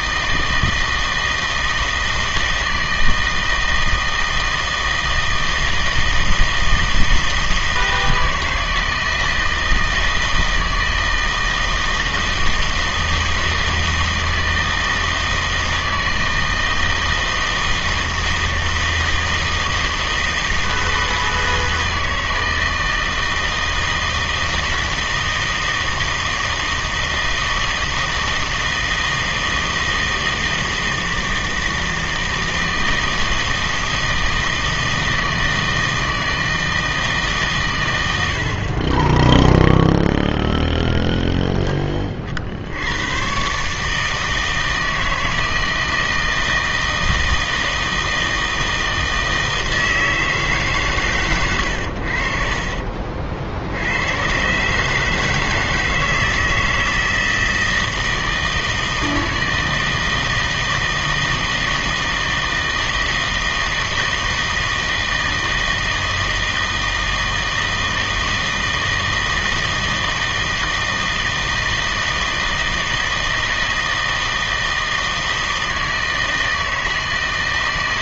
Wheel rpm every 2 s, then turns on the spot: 160, 160, 160, 160, 160, 160, 160, 160, 160, 160, 160, 160, 160, 160, 160, 160, 160, 160, 160, 50, 0, 60, 160, 160, 160, 150, 40, 130, 160, 160, 160, 160, 160, 160, 160, 160, 160, 160, 160.
none